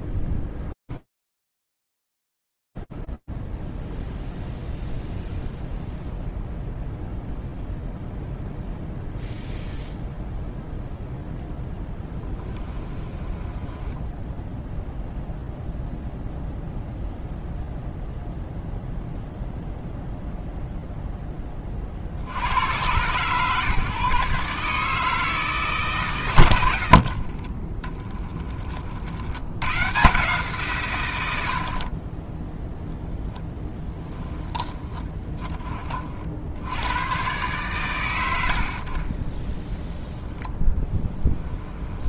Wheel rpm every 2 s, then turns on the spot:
10, 10, 0, 0, 0, 0, 10, 0, 0, 0, 0, 120, 160, 70, 70, 110, 0, 30, 110, 10, 20.
0-4 12-14 26-28 38-40